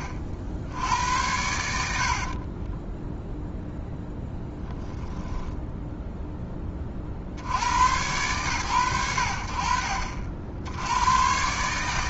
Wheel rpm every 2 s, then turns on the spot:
70, 10, 10, 70, 80, 110.
2-6